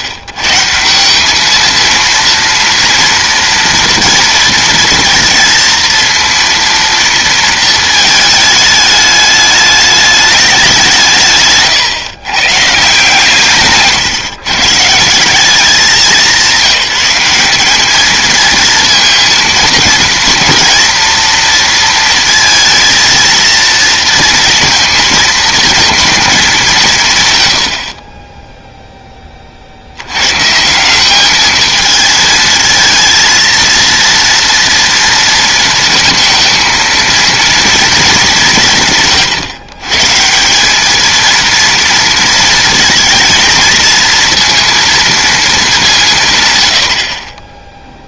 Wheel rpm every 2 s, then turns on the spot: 150, 230, 230, 230, 210, 190, 140, 140, 190, 230, 240, 230, 230, 210, 10, 150, 220, 230, 230, 170, 170, 230, 230, 120.
none